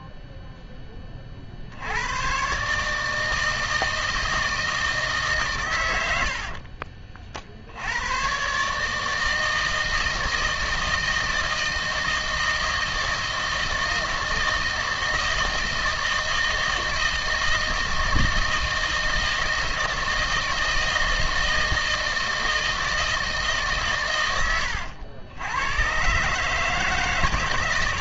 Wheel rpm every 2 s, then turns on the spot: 0, 130, 160, 60, 130, 160, 160, 160, 160, 160, 160, 160, 110, 150.
6-8